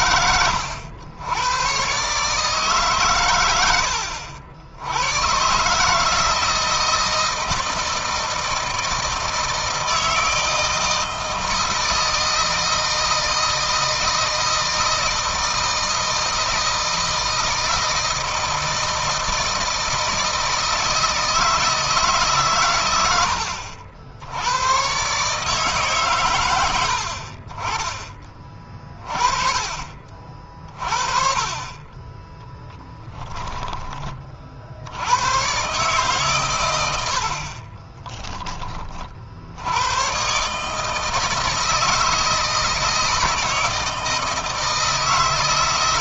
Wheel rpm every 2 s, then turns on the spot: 90, 140, 80, 160, 160, 160, 160, 160, 160, 160, 160, 120, 100, 100, 30, 50, 10, 70, 100, 20, 150, 160, 160.
32-34 36-38